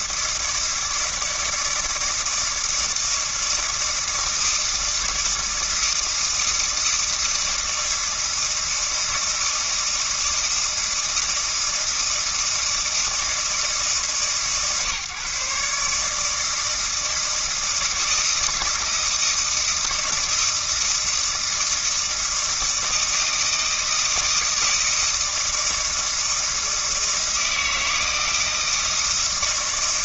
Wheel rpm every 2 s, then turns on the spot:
160, 160, 160, 160, 160, 160, 160, 140, 160, 160, 160, 160, 160, 160, 160.
none